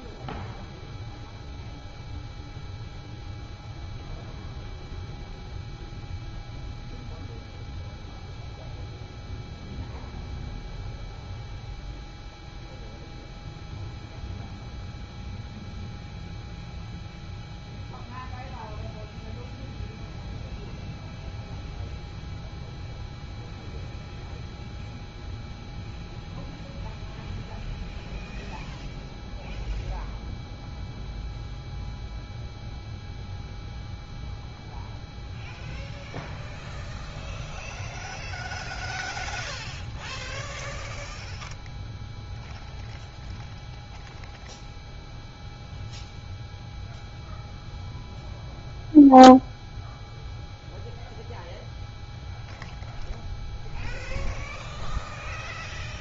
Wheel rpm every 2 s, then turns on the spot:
0, 0, 0, 0, 0, 0, 0, 0, 0, 0, 0, 0, 0, 0, 0, 0, 0, 0, 0, 0, 0, 0, 0, 0, 0, 0, 0, 0.
none